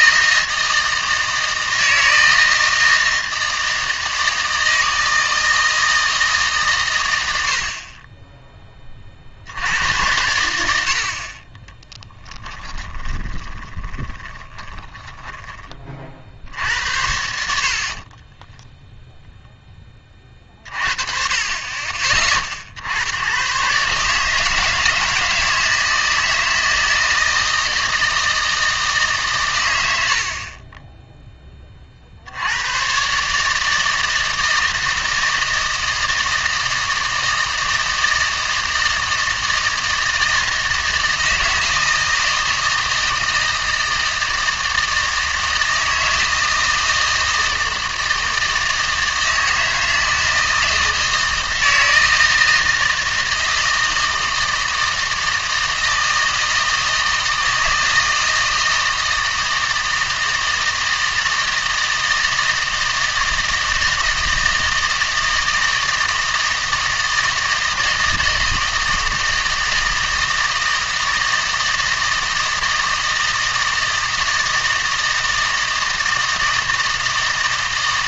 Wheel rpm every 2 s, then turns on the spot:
160, 160, 160, 140, 10, 80, 20, 20, 70, 10, 40, 60, 160, 160, 160, 20, 100, 160, 160, 160, 160, 160, 160, 160, 160, 160, 160, 160, 160, 160, 160, 160, 160, 160, 160, 160, 160, 160, 160.
12-16 18-20